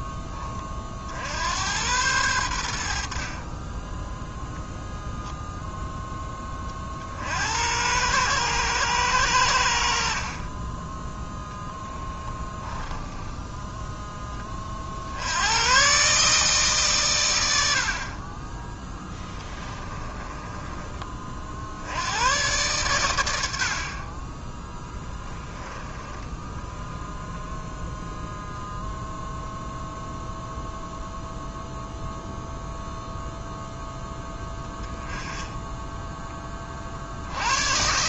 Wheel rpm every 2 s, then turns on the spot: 60, 60, 0, 50, 100, 10, 10, 60, 130, 10, 20, 100, 10, 0, 0, 0, 0, 10, 40.
18-20 24-26